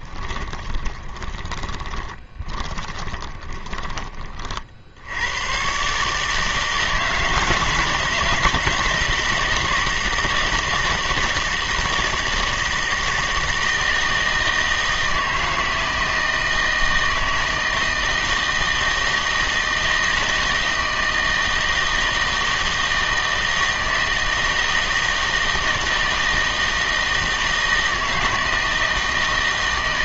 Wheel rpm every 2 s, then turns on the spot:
20, 20, 30, 150, 160, 160, 160, 160, 160, 160, 160, 160, 160, 160, 160.
0-4